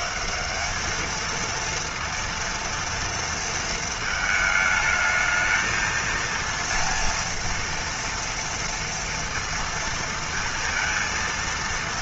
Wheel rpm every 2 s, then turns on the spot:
210, 230, 220, 230, 230, 230.
none